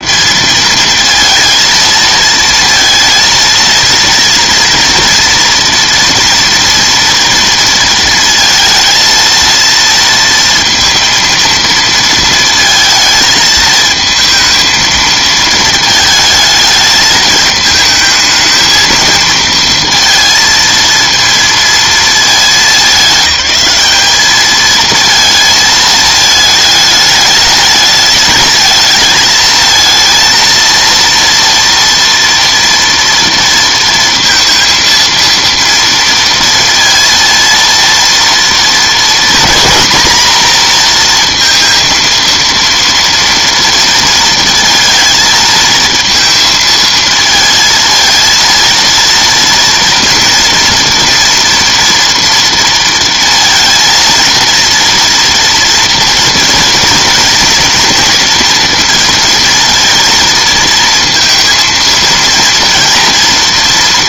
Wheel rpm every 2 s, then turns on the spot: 230, 230, 230, 230, 230, 230, 220, 230, 220, 220, 230, 200, 220, 210, 210, 230, 230, 230, 230, 230, 230, 230, 230, 220, 230, 230, 230, 230, 230, 230, 220, 230.
none